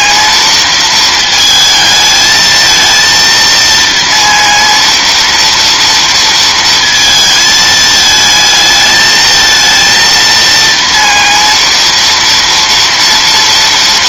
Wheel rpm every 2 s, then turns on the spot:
230, 220, 230, 230, 220, 230, 230.
none